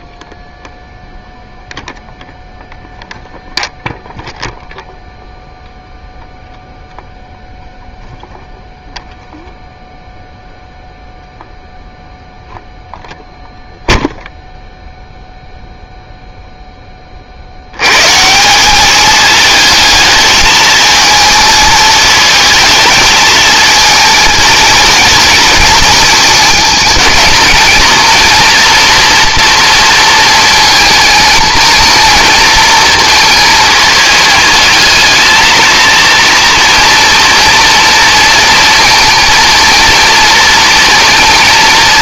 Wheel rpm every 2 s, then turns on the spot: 0, 0, 0, 0, 0, 0, 0, 0, 10, 180, 220, 220, 230, 220, 240, 220, 230, 220, 230, 230, 230.
none